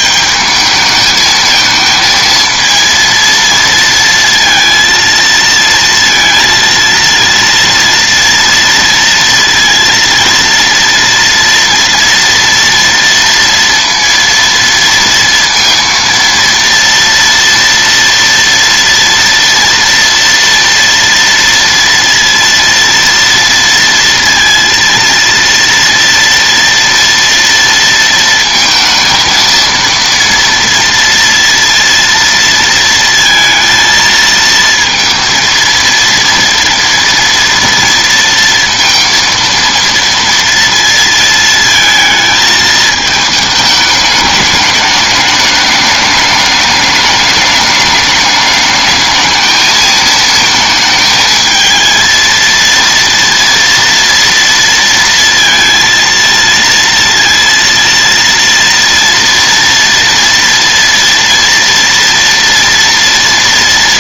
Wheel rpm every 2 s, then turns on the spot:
220, 230, 230, 230, 230, 230, 240, 230, 230, 230, 230, 230, 230, 230, 230, 230, 230, 230, 230, 230, 230, 220, 210, 210, 210, 220, 230, 230, 230, 230, 230, 230.
none